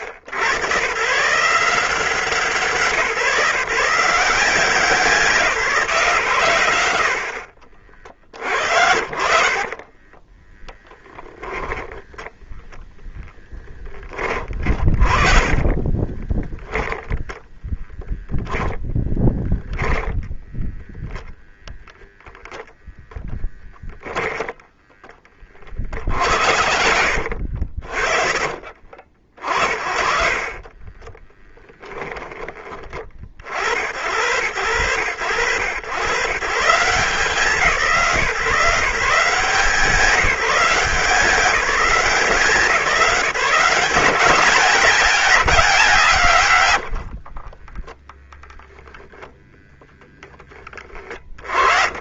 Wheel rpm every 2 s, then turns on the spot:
100, 170, 160, 130, 50, 10, 10, 30, 10, 10, 10, 0, 10, 70, 40, 50, 10, 80, 130, 170, 170, 170, 190, 140, 10, 20.
10-12 14-18 24-26